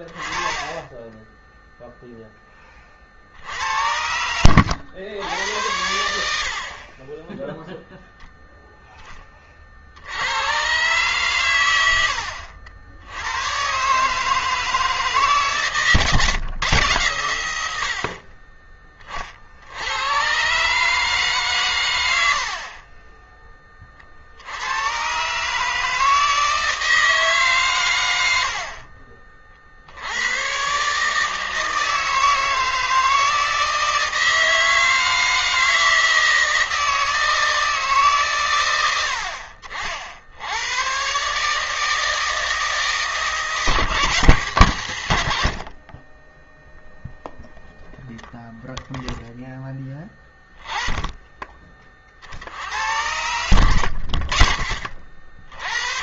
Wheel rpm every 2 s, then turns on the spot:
20, 20, 90, 50, 0, 110, 80, 150, 110, 30, 140, 50, 80, 160, 70, 120, 160, 160, 160, 110, 80, 160, 150, 0, 0, 20, 50, 40.
none